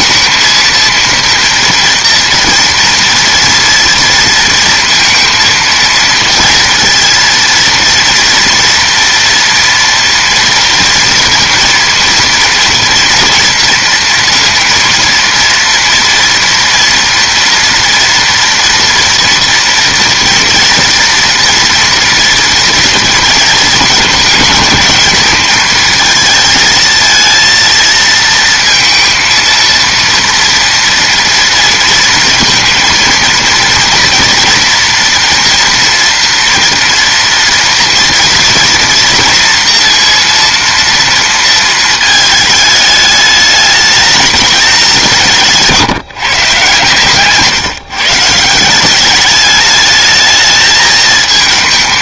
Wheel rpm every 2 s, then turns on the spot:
230, 230, 230, 230, 230, 230, 230, 230, 230, 230, 230, 230, 220, 230, 230, 230, 230, 230, 230, 230, 230, 220, 200, 140, 170, 220.
none